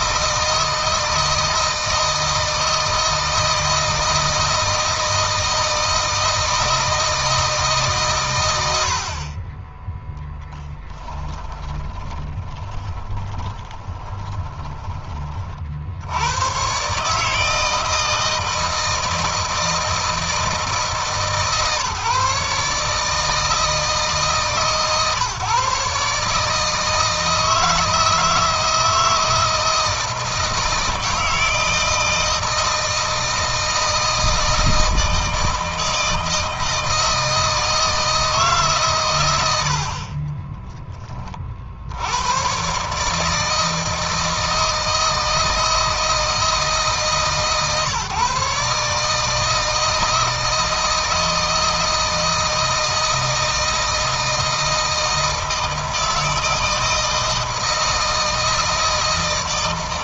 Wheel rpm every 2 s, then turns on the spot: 160, 160, 160, 160, 70, 10, 20, 20, 140, 160, 150, 150, 150, 160, 160, 160, 160, 160, 160, 140, 20, 140, 160, 150, 150, 160, 160, 160, 160, 160.
10-14